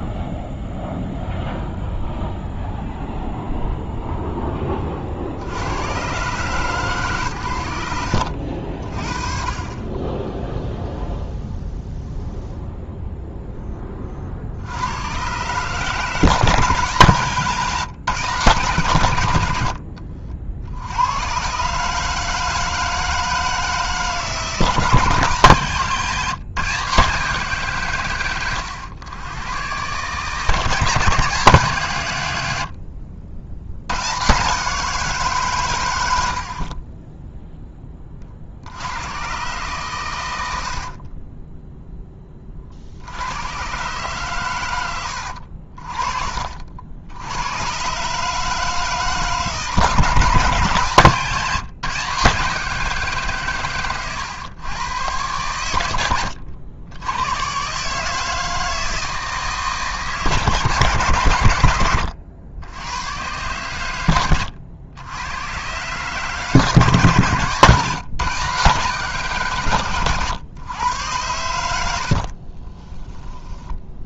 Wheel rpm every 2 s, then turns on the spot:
0, 0, 10, 140, 60, 0, 0, 60, 160, 150, 60, 160, 160, 160, 110, 140, 80, 140, 60, 60, 80, 30, 120, 50, 150, 150, 170, 110, 90, 160, 150, 90, 90, 140, 150, 110, 50.
36-38 40-42 72-74